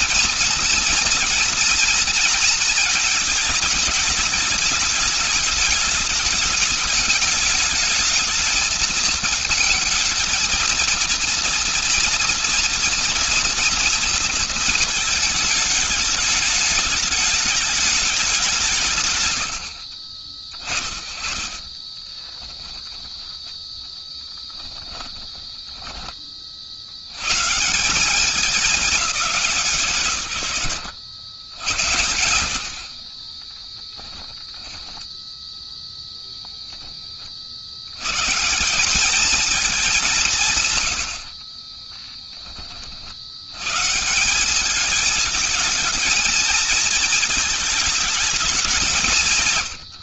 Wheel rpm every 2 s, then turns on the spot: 240, 230, 210, 210, 220, 230, 240, 230, 210, 200, 20, 20, 10, 20, 190, 130, 90, 10, 0, 120, 180, 30, 180, 220, 220.
22-24 34-36